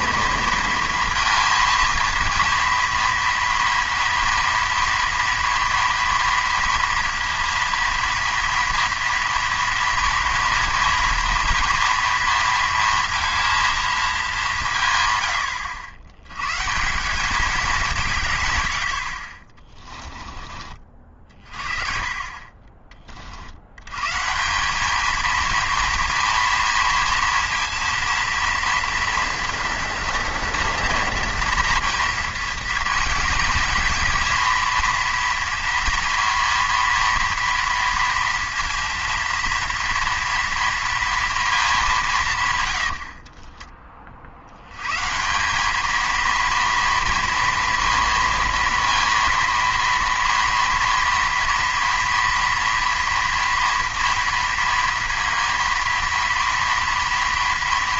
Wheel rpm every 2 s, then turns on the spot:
230, 230, 240, 230, 230, 230, 230, 150, 150, 90, 30, 30, 190, 230, 230, 230, 230, 230, 230, 230, 230, 110, 110, 230, 230, 230, 230, 230, 230.
42-44